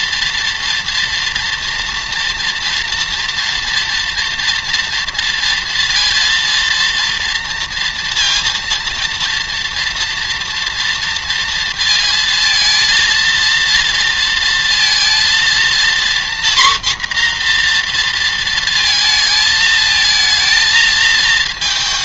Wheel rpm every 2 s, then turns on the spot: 230, 230, 230, 230, 230, 230, 230, 230, 240, 220, 220.
none